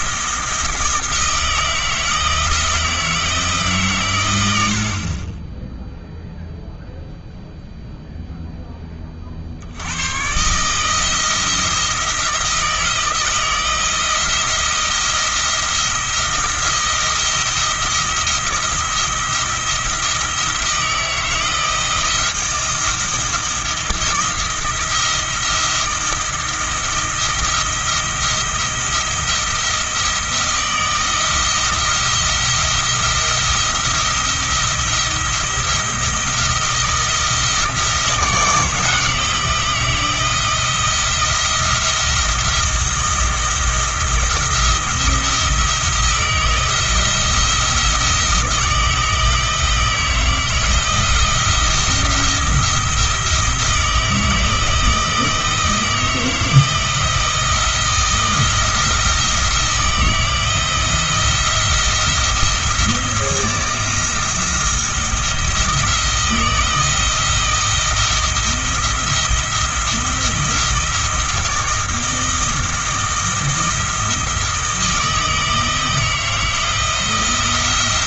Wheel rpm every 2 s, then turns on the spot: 170, 160, 70, 0, 20, 150, 160, 170, 170, 170, 170, 170, 170, 170, 170, 170, 170, 170, 170, 160, 160, 170, 170, 170, 160, 170, 170, 160, 170, 170, 160, 170, 170, 160, 170, 170, 170, 160, 170.
none